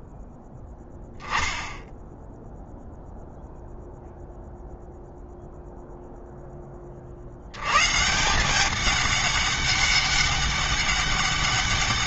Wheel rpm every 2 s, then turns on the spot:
10, 0, 0, 20, 190, 200.
none